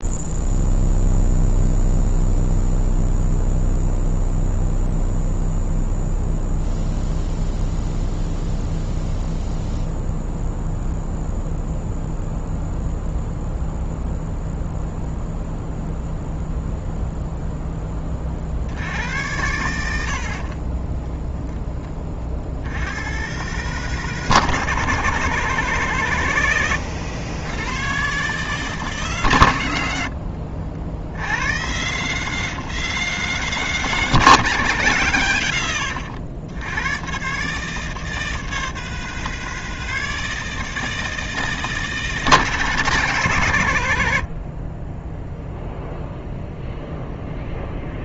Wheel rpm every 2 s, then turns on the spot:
0, 0, 0, 0, 0, 0, 0, 0, 0, 70, 20, 90, 160, 100, 150, 60, 160, 120, 110, 160, 160, 160, 30, 0.
20-22